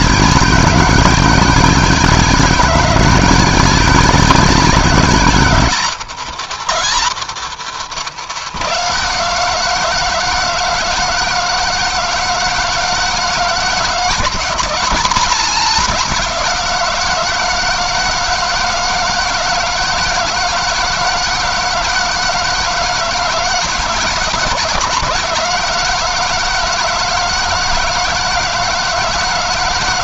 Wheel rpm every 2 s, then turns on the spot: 190, 180, 190, 220, 190, 160, 160, 180, 170, 160, 160, 160, 160, 160, 170.
none